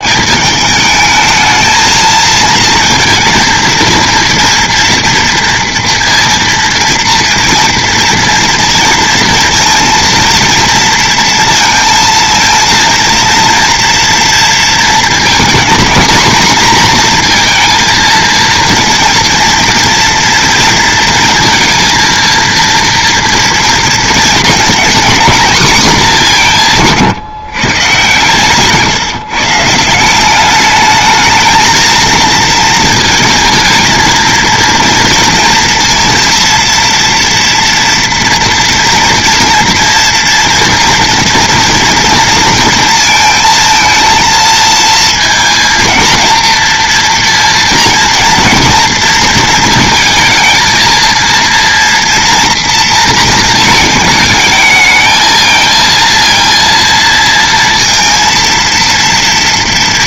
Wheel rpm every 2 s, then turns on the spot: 210, 230, 230, 230, 230, 230, 230, 230, 240, 230, 230, 230, 220, 160, 140, 210, 220, 230, 230, 230, 230, 230, 230, 230, 240, 230, 230, 220, 230, 230.
none